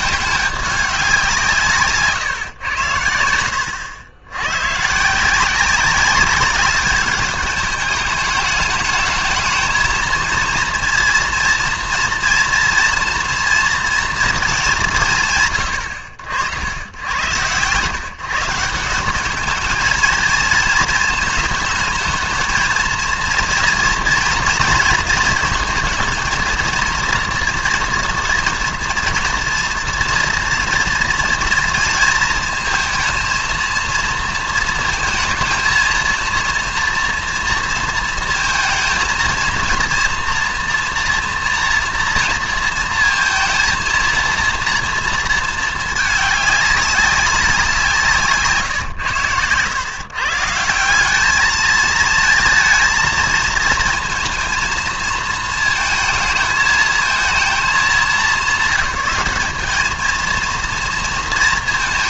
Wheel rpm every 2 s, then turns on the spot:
200, 110, 120, 200, 210, 230, 230, 210, 90, 160, 220, 220, 230, 230, 230, 230, 230, 230, 230, 220, 230, 230, 230, 200, 140, 160, 220, 230, 220, 200, 230.
none